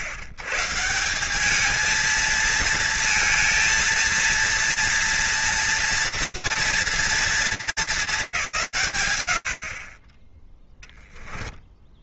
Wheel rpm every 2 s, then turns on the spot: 130, 220, 230, 230, 170, 10.
10-12